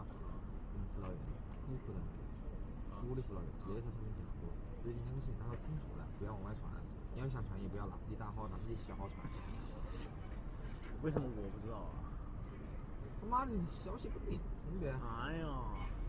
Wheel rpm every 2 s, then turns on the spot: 0, 0, 0, 0, 0, 0, 0, 0.
none